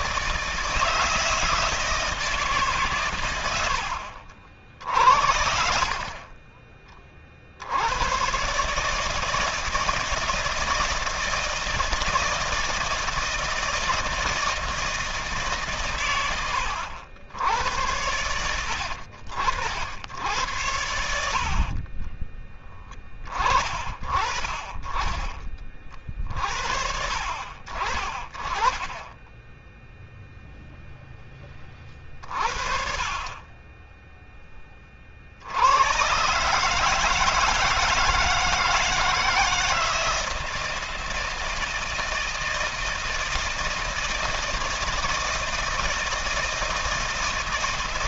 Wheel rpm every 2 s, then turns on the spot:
150, 130, 80, 30, 160, 160, 160, 160, 80, 80, 80, 20, 20, 60, 10, 10, 50, 40, 150, 160, 160, 160, 160, 160.
none